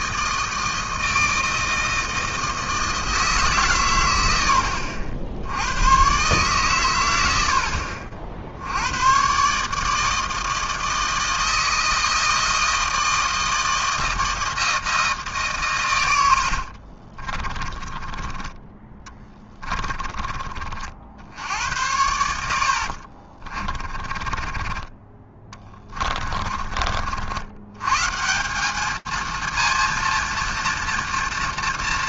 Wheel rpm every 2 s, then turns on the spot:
160, 160, 100, 130, 70, 160, 160, 160, 70, 20, 30, 80, 40, 40, 180, 230.
16-20 24-28